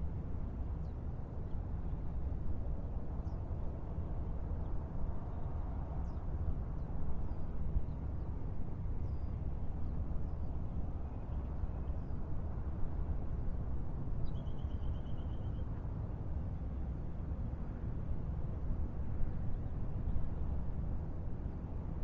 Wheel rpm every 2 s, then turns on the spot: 0, 0, 0, 0, 0, 0, 0, 0, 0, 0, 0.
none